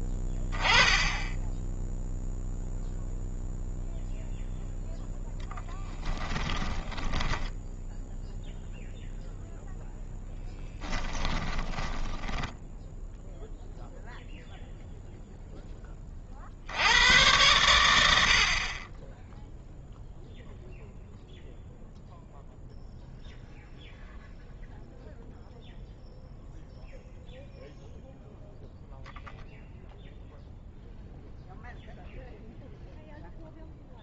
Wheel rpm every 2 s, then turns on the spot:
10, 0, 0, 10, 0, 10, 10, 0, 90, 20, 0, 0, 0, 0, 0, 0, 0.
6-8 10-14